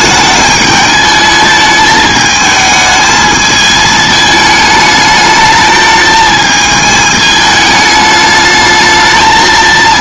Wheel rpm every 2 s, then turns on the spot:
210, 220, 210, 220, 220.
none